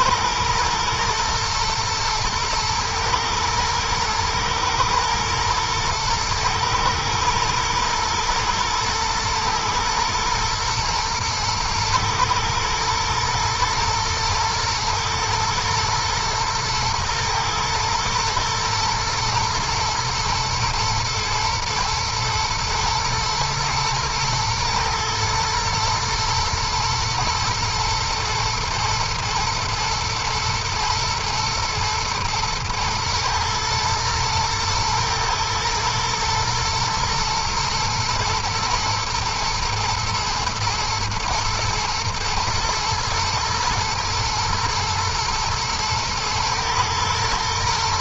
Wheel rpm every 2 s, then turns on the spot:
120, 110, 110, 110, 110, 120, 120, 110, 110, 120, 120, 110, 110, 110, 110, 110, 110, 110, 110, 110, 120, 110, 120, 110.
none